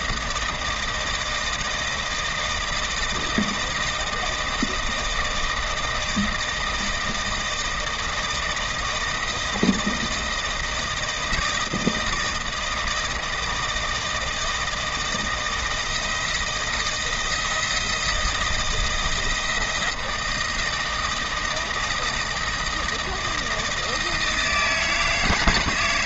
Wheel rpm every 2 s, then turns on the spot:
160, 160, 160, 160, 160, 170, 160, 160, 170, 160, 160, 160, 160.
none